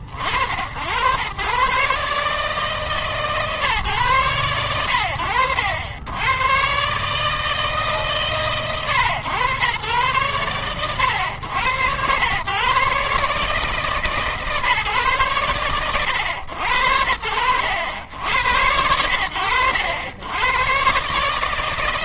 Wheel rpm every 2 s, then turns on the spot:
60, 140, 120, 90, 140, 110, 120, 140, 90, 80, 100.
none